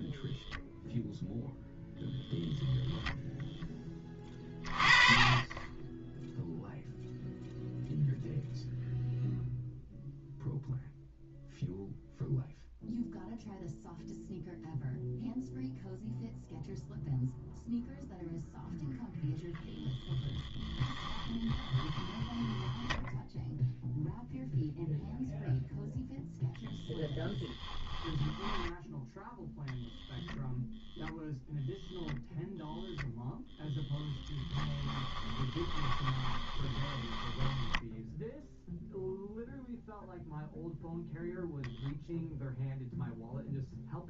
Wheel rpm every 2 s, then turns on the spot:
0, 0, 30, 0, 0, 0, 0, 0, 0, 0, 10, 10, 0, 0, 10, 0, 0, 10, 20, 0, 0, 0.
20-22 34-38